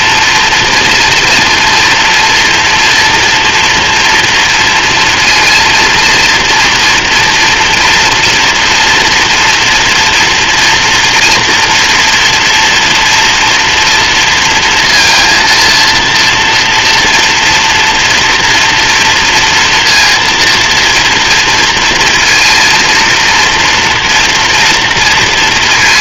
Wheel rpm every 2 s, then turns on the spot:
230, 240, 230, 230, 230, 230, 230, 230, 230, 230, 230, 230, 230.
none